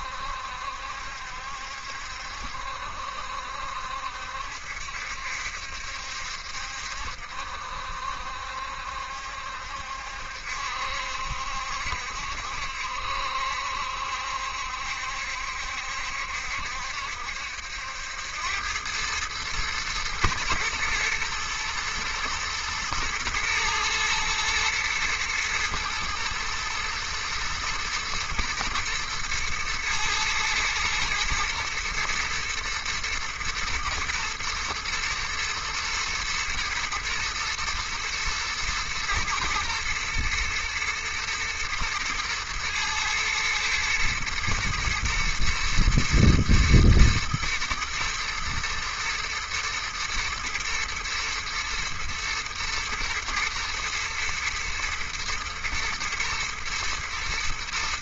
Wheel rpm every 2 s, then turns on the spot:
70, 70, 70, 70, 70, 70, 70, 70, 70, 90, 120, 110, 110, 110, 120, 110, 120, 120, 110, 120, 110, 110, 110, 120, 110, 120, 110, 120, 120.
none